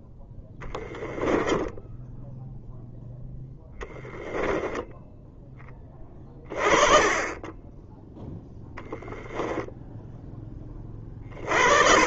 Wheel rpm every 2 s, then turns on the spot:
10, 0, 10, 30, 0, 20.
0-2